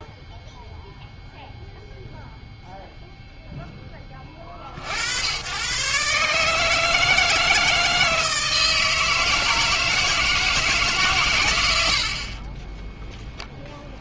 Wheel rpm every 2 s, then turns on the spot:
0, 0, 50, 150, 160, 160, 20.
12-14